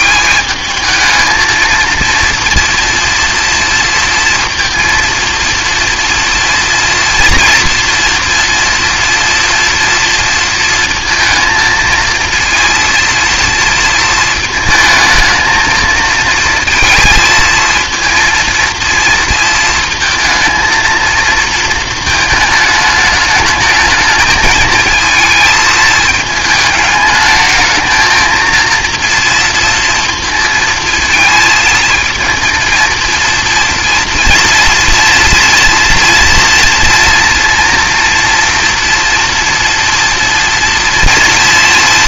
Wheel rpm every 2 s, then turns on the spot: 210, 230, 230, 230, 230, 230, 230, 220, 230, 230, 220, 210, 220, 220, 230, 230, 230, 230, 230, 230, 230.
none